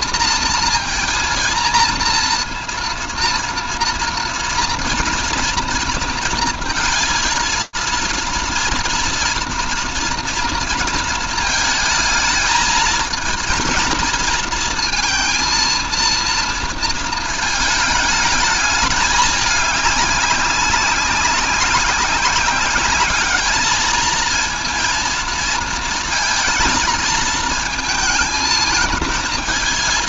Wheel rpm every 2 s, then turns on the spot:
230, 230, 230, 230, 230, 230, 220, 230, 220, 210, 190, 200, 230, 220, 220.
none